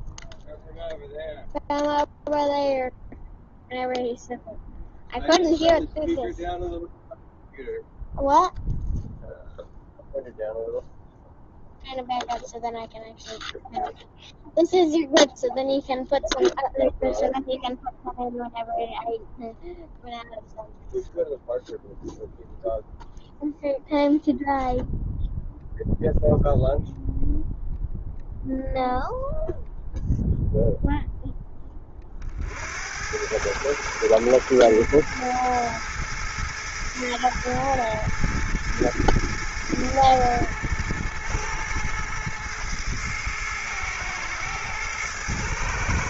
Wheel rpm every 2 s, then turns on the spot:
0, 0, 0, 0, 0, 0, 0, 0, 0, 0, 0, 0, 0, 0, 0, 0, 80, 110, 110, 110, 110, 110, 110.
none